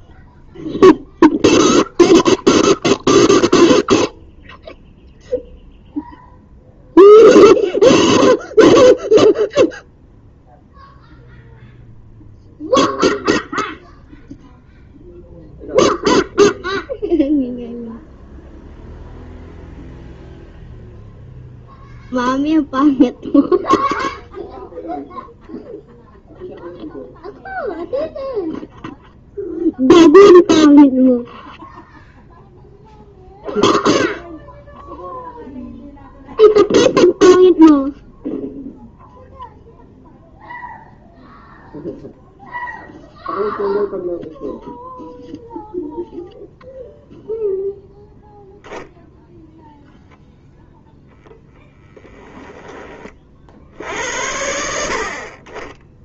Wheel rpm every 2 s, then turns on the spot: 0, 0, 0, 0, 0, 0, 0, 0, 0, 0, 0, 0, 0, 0, 0, 0, 0, 0, 0, 0, 0, 0, 0, 0, 0, 0, 10, 70.
none